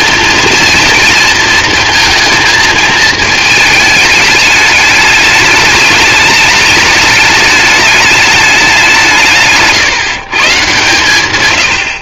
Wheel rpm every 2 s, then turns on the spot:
230, 220, 210, 210, 190, 130.
none